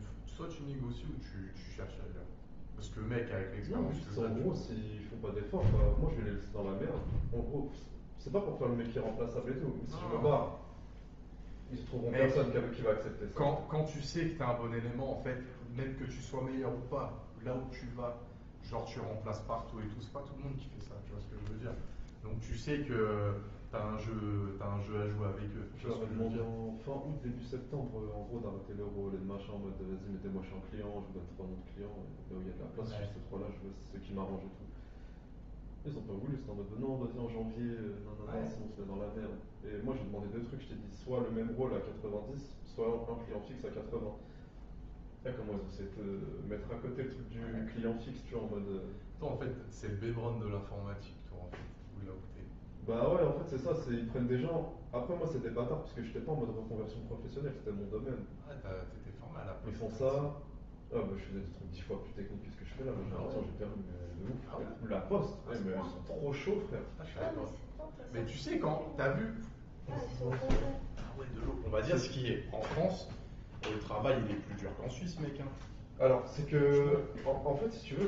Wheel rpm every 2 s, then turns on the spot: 0, 0, 0, 0, 0, 0, 0, 0, 0, 0, 0, 0, 0, 0, 0, 0, 0, 0, 0, 0, 0, 0, 0, 0, 0, 0, 0, 0, 0, 0, 0, 0, 0, 0, 0, 0, 0, 0, 0.
none